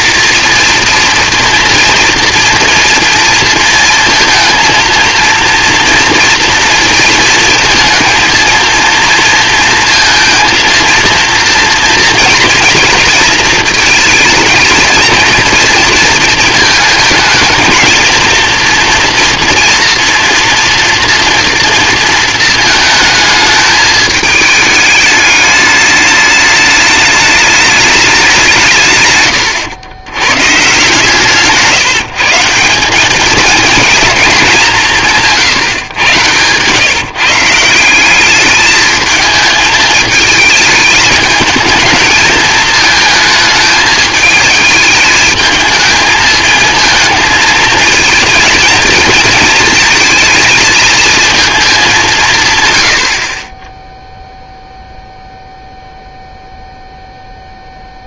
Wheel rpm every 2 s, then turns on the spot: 230, 230, 220, 230, 230, 230, 230, 220, 220, 230, 240, 220, 220, 210, 160, 130, 180, 200, 110, 210, 210, 220, 220, 220, 230, 220, 120, 0, 0.
none